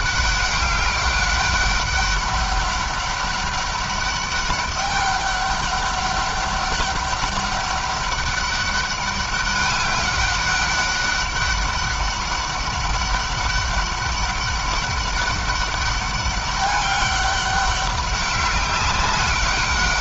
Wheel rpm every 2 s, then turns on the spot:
200, 200, 200, 200, 200, 200, 200, 200, 200, 190.
none